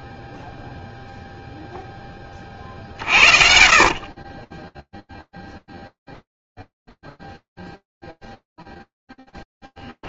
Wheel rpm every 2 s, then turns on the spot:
0, 50, 0, 0, 0.
none